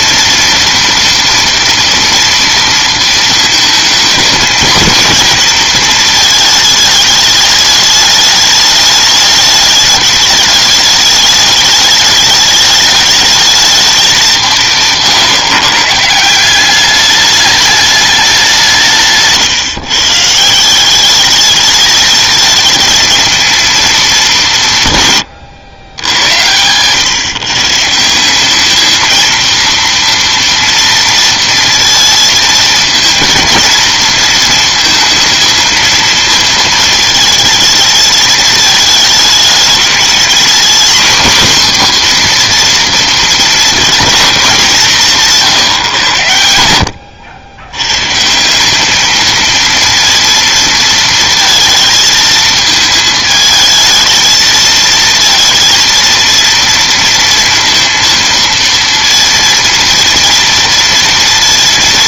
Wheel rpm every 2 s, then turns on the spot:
230, 230, 220, 220, 210, 210, 210, 160, 180, 180, 170, 220, 160, 110, 210, 230, 230, 230, 220, 210, 240, 240, 200, 90, 180, 230, 220, 220, 230, 230, 230.
none